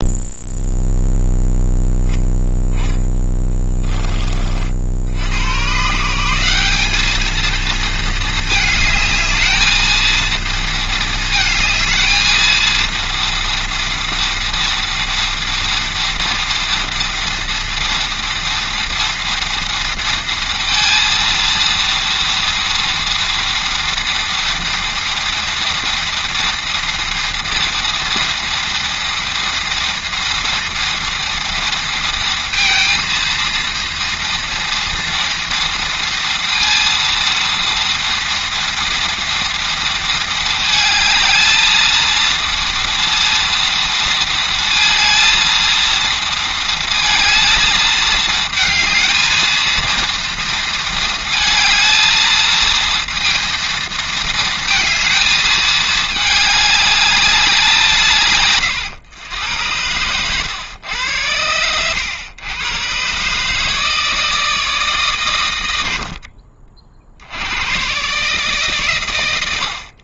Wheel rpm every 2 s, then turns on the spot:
0, 10, 50, 200, 220, 220, 230, 230, 230, 240, 230, 230, 230, 230, 230, 230, 230, 230, 230, 230, 220, 230, 230, 230, 220, 230, 230, 220, 210, 130, 110, 120, 150, 50, 140.
none